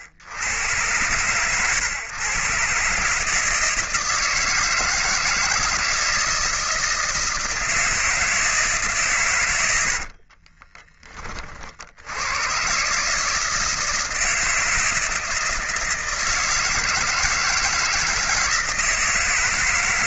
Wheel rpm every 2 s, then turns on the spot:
90, 130, 160, 160, 160, 40, 120, 160, 160, 160.
10-12